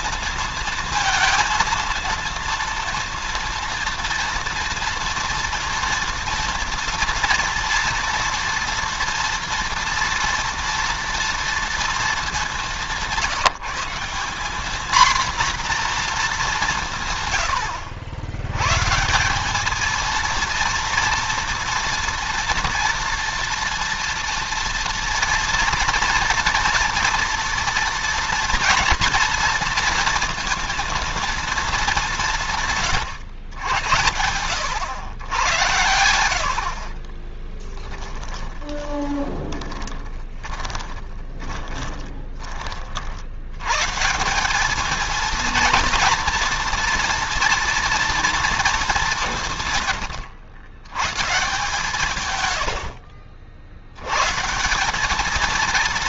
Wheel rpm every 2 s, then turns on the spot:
230, 230, 230, 230, 230, 230, 190, 220, 170, 130, 230, 230, 230, 240, 240, 230, 140, 90, 60, 10, 10, 40, 210, 230, 220, 120, 80, 180.
36-42